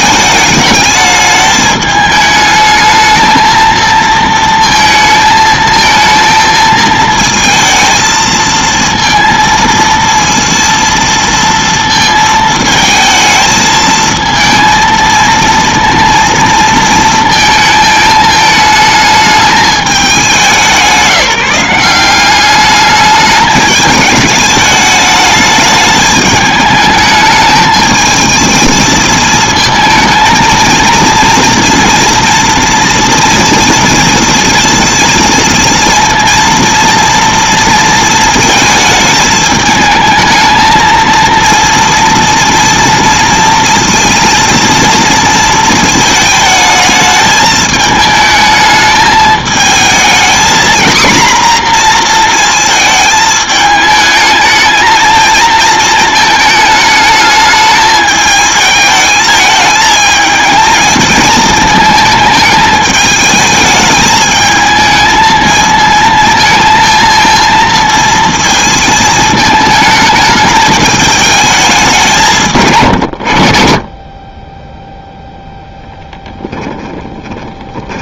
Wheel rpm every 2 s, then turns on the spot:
210, 220, 230, 220, 230, 230, 220, 230, 230, 210, 180, 210, 210, 210, 220, 230, 230, 230, 230, 220, 230, 230, 230, 220, 220, 240, 220, 220, 220, 210, 220, 210, 220, 220, 220, 210, 120, 10, 10.
72-74 76-78